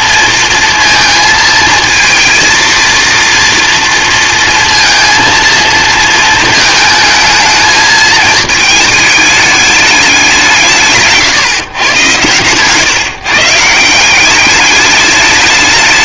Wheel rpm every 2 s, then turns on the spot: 230, 230, 230, 220, 220, 160, 130, 200.
none